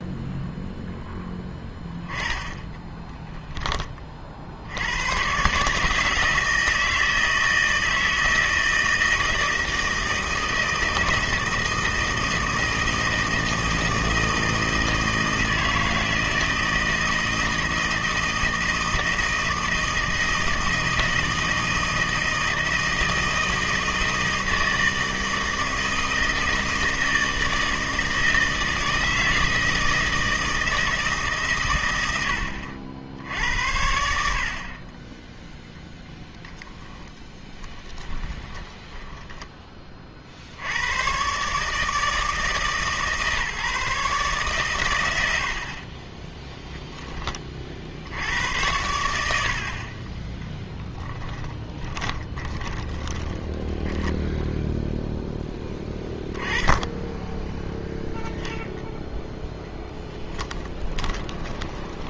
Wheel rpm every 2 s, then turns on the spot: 0, 20, 80, 160, 160, 160, 160, 160, 160, 160, 160, 160, 160, 160, 160, 160, 80, 40, 10, 20, 90, 150, 130, 10, 90, 10, 30, 0, 10, 0, 10.
2-4 36-40 50-54 60-62